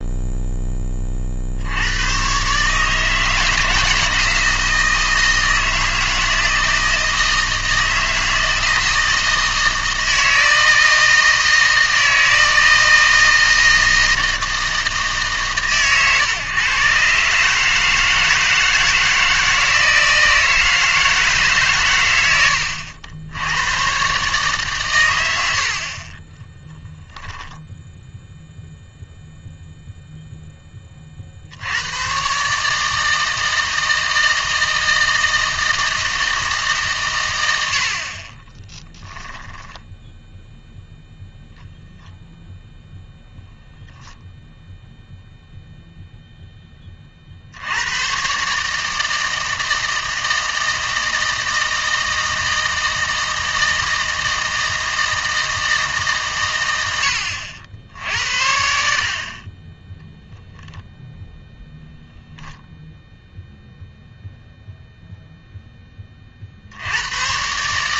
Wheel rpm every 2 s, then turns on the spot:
10, 140, 160, 160, 160, 160, 160, 160, 120, 160, 160, 90, 130, 20, 0, 10, 150, 160, 140, 20, 0, 0, 10, 10, 150, 160, 160, 160, 90, 60, 0, 0, 0, 70.
26-28 38-40